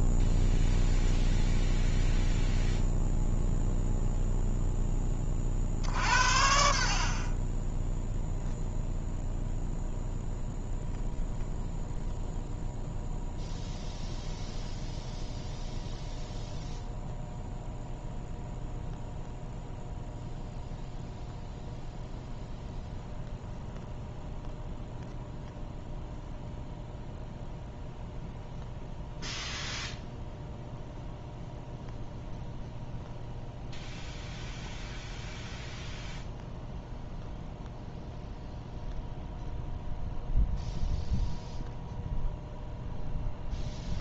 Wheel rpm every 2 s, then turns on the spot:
0, 0, 0, 60, 0, 0, 0, 0, 0, 0, 0, 0, 0, 0, 0, 0, 0, 0, 0, 0, 0, 0.
none